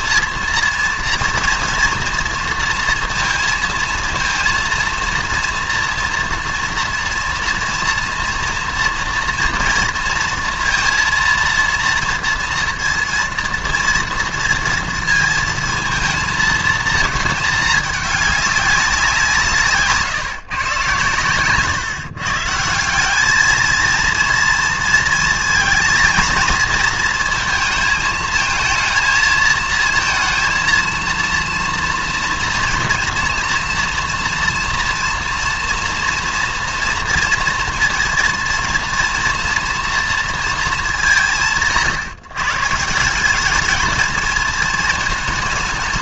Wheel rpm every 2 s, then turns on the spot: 230, 230, 230, 230, 230, 230, 230, 230, 230, 200, 130, 170, 230, 220, 230, 230, 230, 230, 230, 230, 210, 150, 220.
none